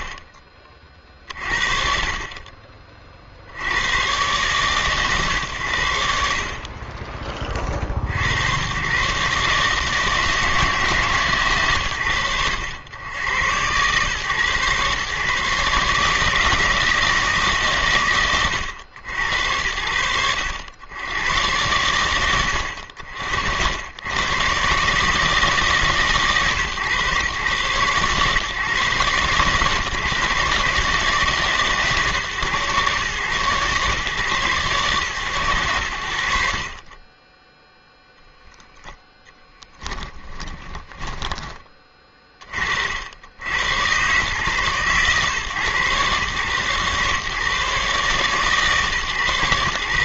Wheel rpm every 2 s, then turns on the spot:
30, 60, 120, 40, 150, 110, 120, 140, 130, 60, 90, 80, 150, 130, 130, 150, 120, 130, 30, 10, 10, 70, 120, 120, 140.
40-42